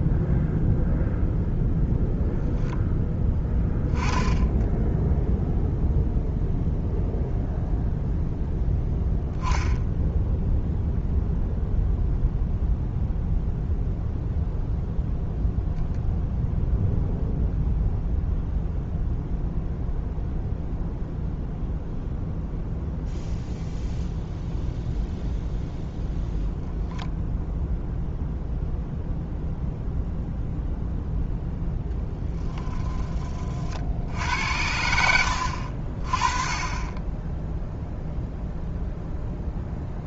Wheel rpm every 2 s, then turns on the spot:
0, 0, 0, 0, 0, 0, 0, 0, 0, 0, 0, 0, 0, 0, 0, 0, 10, 70, 10, 0.
none